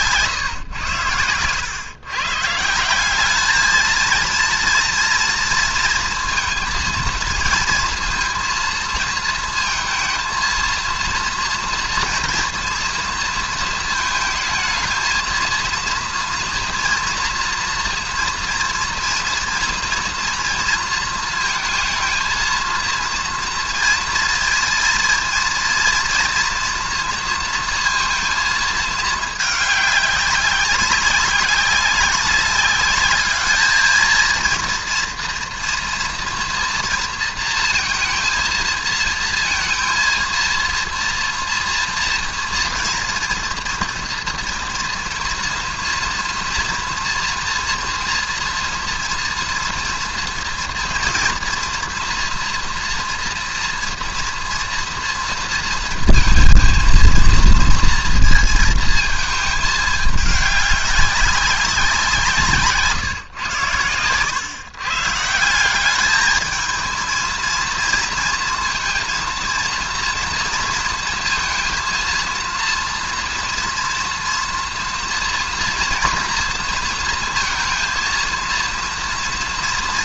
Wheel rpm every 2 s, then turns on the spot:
120, 150, 230, 230, 230, 230, 230, 220, 230, 230, 230, 230, 230, 230, 220, 200, 200, 230, 240, 230, 240, 240, 230, 230, 230, 230, 240, 230, 230, 230, 200, 150, 140, 220, 230, 230, 230, 230, 230, 230.
none